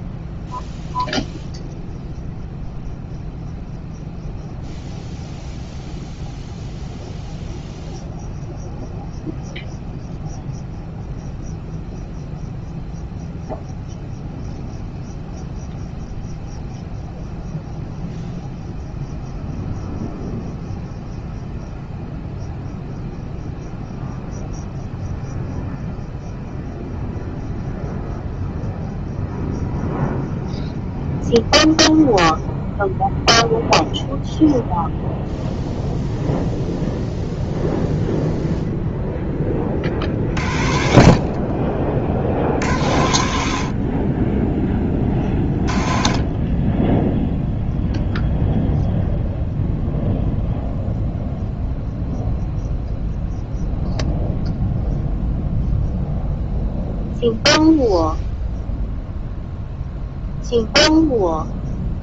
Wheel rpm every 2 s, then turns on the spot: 0, 0, 0, 0, 0, 0, 0, 0, 0, 0, 0, 0, 0, 0, 0, 0, 0, 0, 0, 0, 60, 60, 20, 20, 0, 0, 0, 0, 0, 0, 0.
none